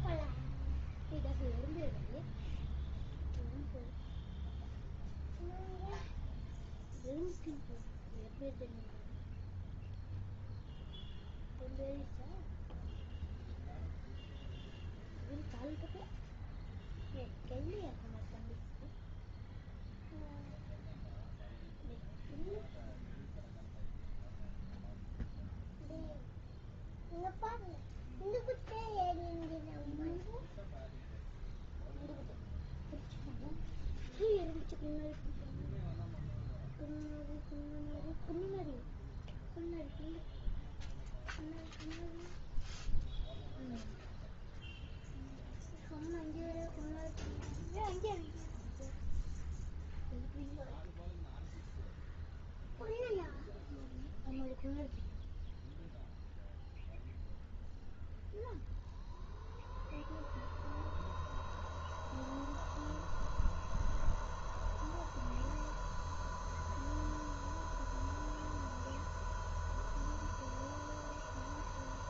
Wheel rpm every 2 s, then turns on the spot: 0, 0, 0, 0, 0, 0, 0, 0, 0, 0, 0, 0, 0, 0, 0, 0, 0, 0, 0, 0, 0, 0, 0, 0, 0, 0, 0, 0, 0, 0, 0, 0, 0, 0, 0, 0.
none